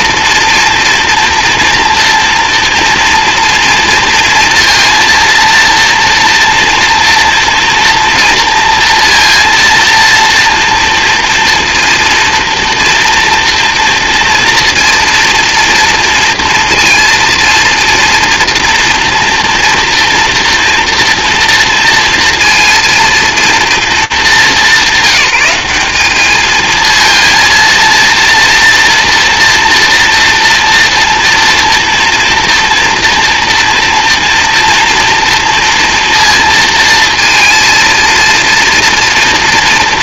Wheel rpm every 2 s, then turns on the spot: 230, 240, 230, 230, 230, 230, 230, 230, 230, 230, 230, 230, 190, 230, 230, 230, 230, 230, 230, 230.
none